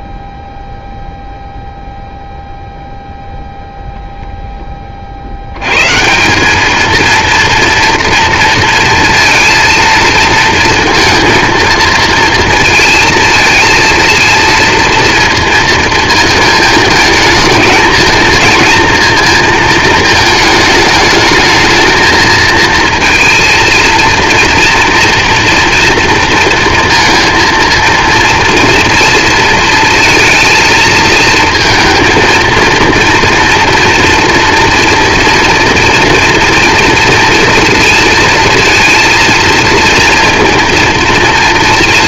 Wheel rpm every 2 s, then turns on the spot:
0, 0, 50, 230, 230, 230, 220, 230, 220, 230, 220, 230, 230, 230, 230, 230, 230, 230, 230, 230, 230.
none